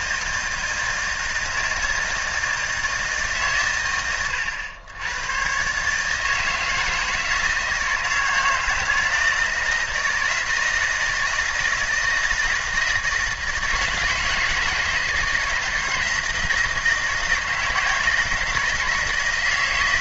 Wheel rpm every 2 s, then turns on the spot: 160, 160, 100, 160, 160, 160, 160, 160, 160, 170.
none